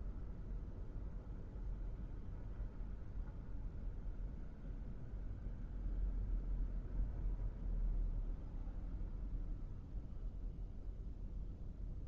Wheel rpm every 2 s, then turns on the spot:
0, 0, 0, 0, 0, 0.
none